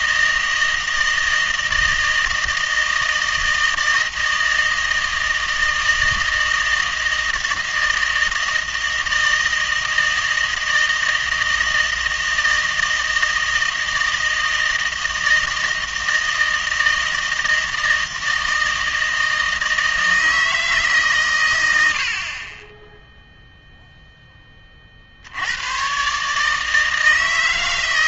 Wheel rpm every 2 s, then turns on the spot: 160, 160, 160, 160, 160, 160, 160, 160, 160, 160, 160, 20, 30, 160.
none